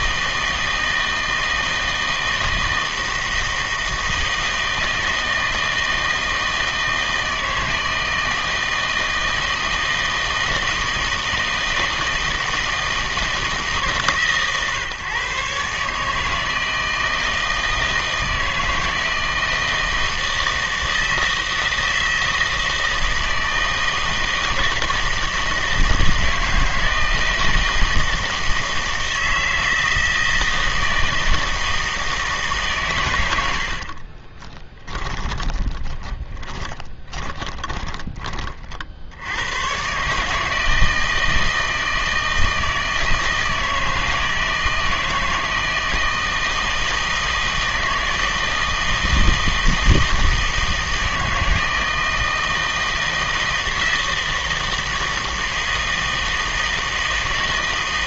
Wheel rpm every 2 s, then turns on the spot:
160, 160, 160, 160, 160, 160, 160, 130, 160, 160, 160, 160, 160, 160, 160, 160, 150, 20, 20, 40, 160, 160, 160, 160, 160, 160, 160, 160, 160.
34-38